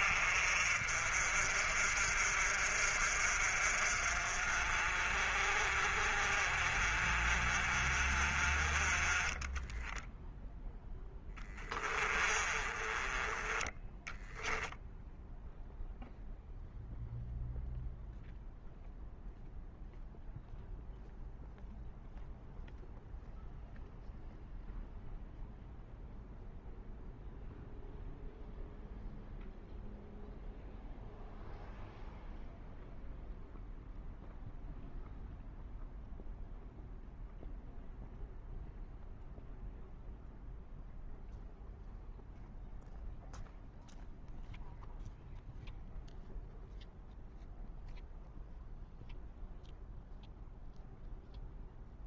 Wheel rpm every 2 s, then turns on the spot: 50, 50, 40, 40, 30, 0, 20, 0, 0, 0, 0, 0, 0, 0, 0, 0, 0, 0, 0, 0, 0, 0, 0, 0, 0, 0.
12-14